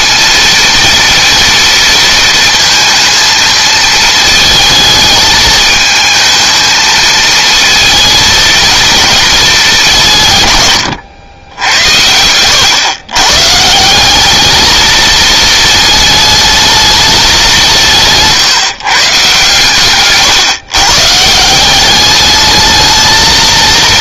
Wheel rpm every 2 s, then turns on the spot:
230, 230, 220, 220, 230, 110, 110, 220, 220, 150, 140, 220.
none